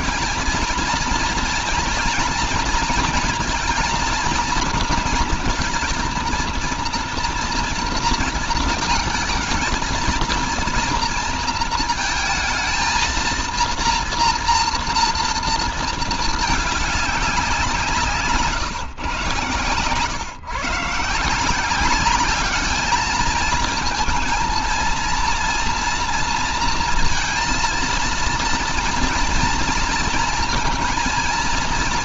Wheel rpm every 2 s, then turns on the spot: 230, 240, 230, 240, 220, 230, 230, 230, 190, 120, 160, 220, 230, 230, 230, 230.
none